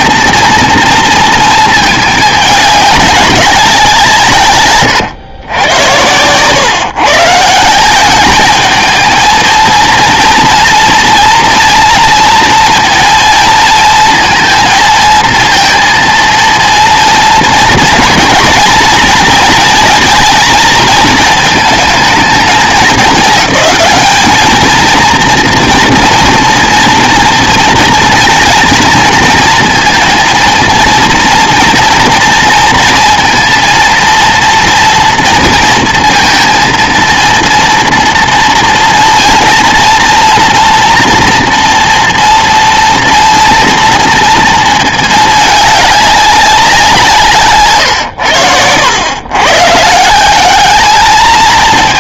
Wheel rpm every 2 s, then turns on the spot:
230, 210, 130, 130, 210, 230, 230, 230, 230, 230, 220, 220, 220, 230, 230, 230, 230, 230, 230, 230, 240, 230, 230, 180, 100, 210.
none